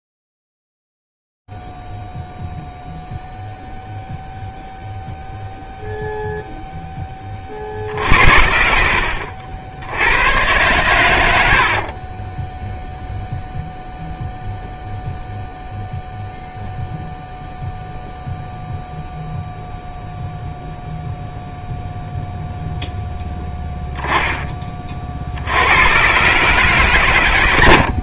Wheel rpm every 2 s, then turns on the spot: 0, 0, 0, 0, 60, 110, 10, 0, 0, 0, 0, 0, 20, 140.
none